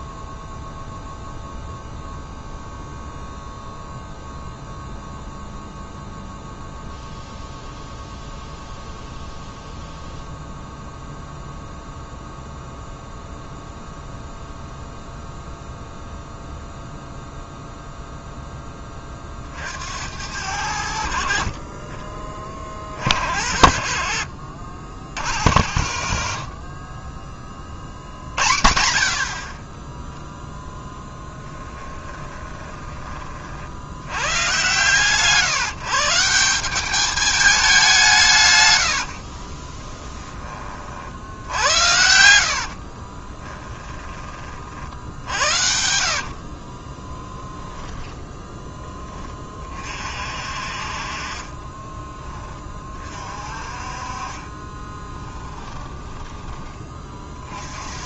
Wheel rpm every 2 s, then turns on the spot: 0, 0, 0, 0, 0, 0, 0, 0, 0, 10, 80, 40, 60, 40, 80, 0, 20, 120, 190, 100, 40, 50, 50, 50, 10, 40, 30, 20, 20.
32-34 38-40 42-44 46-48 54-56